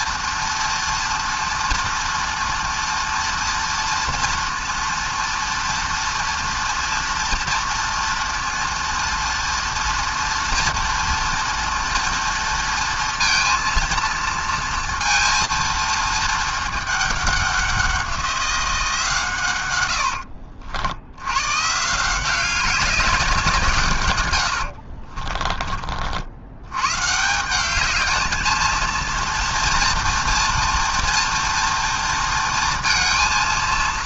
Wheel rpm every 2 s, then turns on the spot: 230, 230, 230, 240, 230, 230, 230, 230, 230, 190, 100, 160, 150, 40, 200, 240, 230.
none